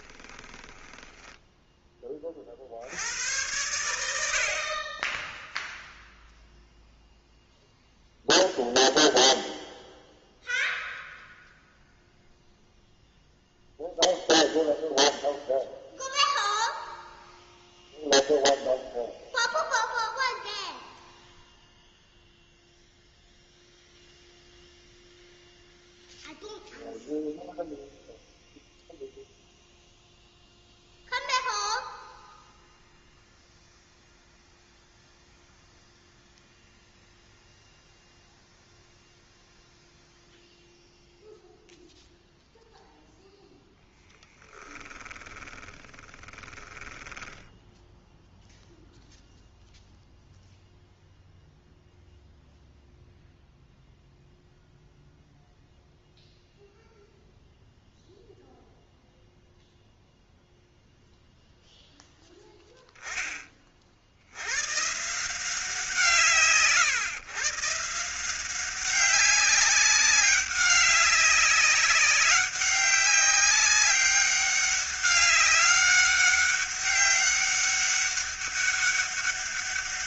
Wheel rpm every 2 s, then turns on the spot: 10, 80, 20, 0, 0, 0, 0, 0, 0, 0, 0, 0, 0, 0, 0, 0, 0, 0, 0, 0, 0, 0, 20, 20, 0, 0, 0, 0, 0, 0, 0, 10, 120, 150, 190, 200, 200, 200, 200, 200.
0-2 44-48